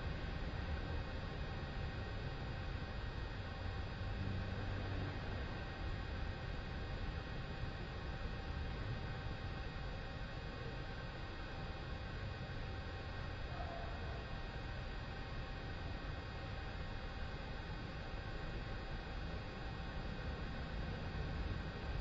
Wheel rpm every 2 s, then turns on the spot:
0, 0, 0, 0, 0, 0, 0, 0, 0, 0, 0.
none